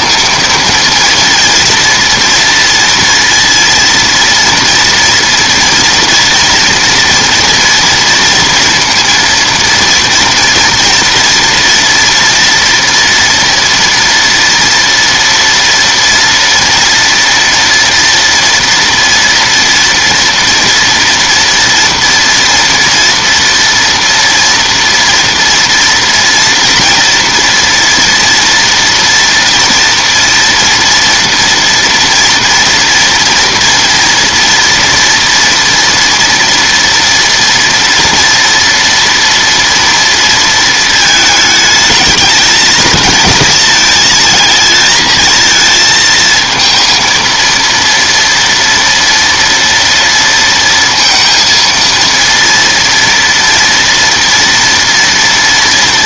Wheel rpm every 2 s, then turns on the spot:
230, 230, 240, 230, 230, 230, 230, 230, 230, 230, 230, 230, 230, 230, 230, 230, 240, 230, 230, 230, 220, 220, 220, 230, 230, 230, 230, 230.
none